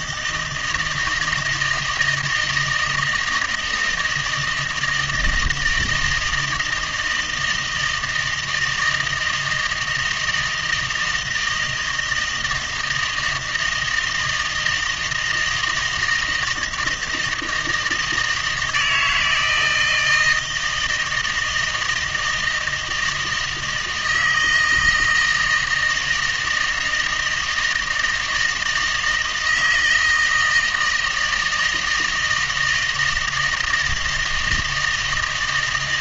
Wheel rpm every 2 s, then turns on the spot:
160, 160, 160, 160, 160, 160, 160, 160, 160, 160, 160, 170, 160, 160, 160, 160, 160, 160.
none